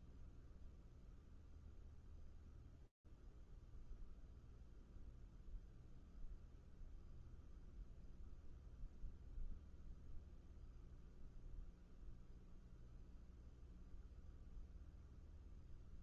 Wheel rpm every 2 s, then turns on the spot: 0, 0, 0, 0, 0, 0, 0, 0.
none